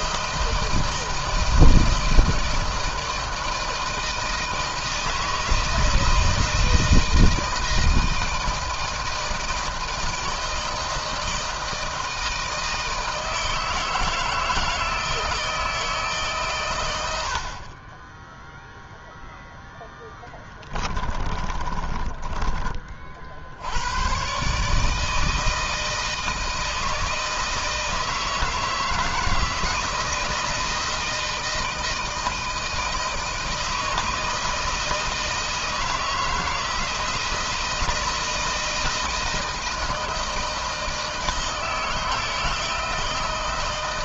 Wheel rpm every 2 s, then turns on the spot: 160, 160, 160, 160, 160, 160, 160, 160, 100, 0, 20, 30, 150, 160, 160, 160, 160, 160, 160, 160, 160, 160.
20-22